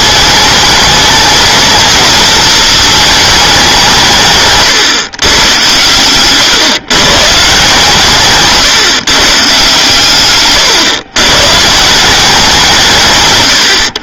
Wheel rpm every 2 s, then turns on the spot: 210, 220, 150, 120, 130, 130, 160.
none